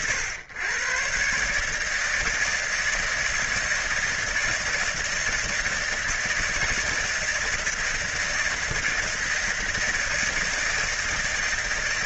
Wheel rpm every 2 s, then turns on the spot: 110, 160, 160, 160, 160, 160.
none